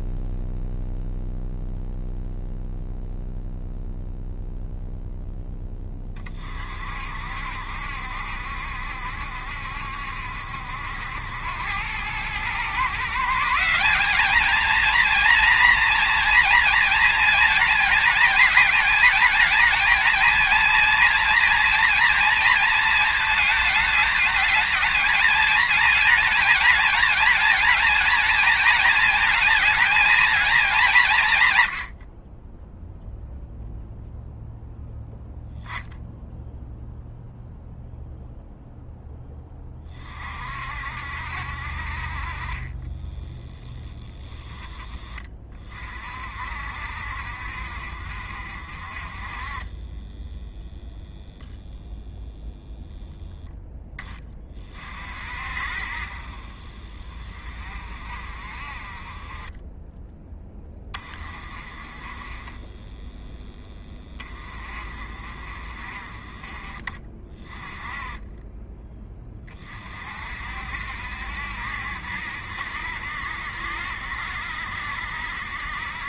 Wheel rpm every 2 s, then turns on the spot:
0, 0, 0, 50, 70, 80, 140, 230, 230, 220, 230, 220, 220, 230, 220, 190, 0, 0, 0, 0, 60, 20, 20, 60, 40, 0, 0, 40, 30, 30, 20, 10, 30, 30, 10, 60, 60, 70.
42-44 62-64